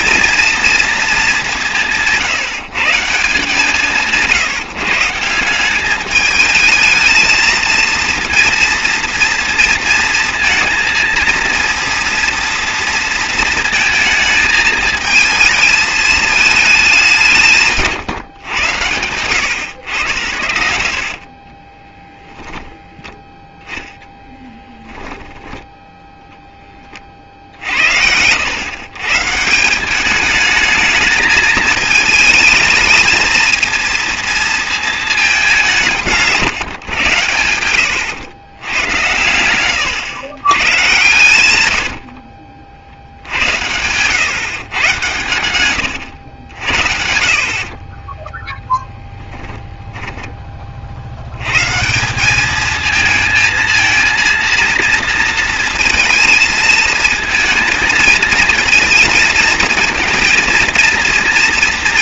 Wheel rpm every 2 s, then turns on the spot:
230, 160, 170, 220, 230, 230, 230, 220, 220, 100, 60, 10, 10, 20, 120, 220, 230, 230, 150, 110, 130, 60, 120, 80, 10, 40, 210, 230, 220, 220, 230.
20-24 36-38